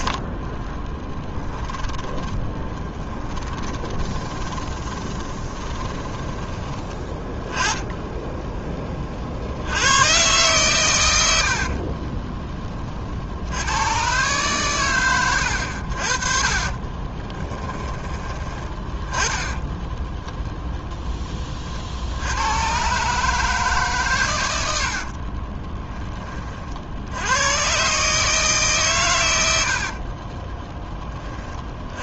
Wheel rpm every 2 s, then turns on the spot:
30, 20, 20, 20, 20, 110, 20, 120, 30, 20, 0, 110, 90, 50, 160, 20.
0-6 16-18 24-26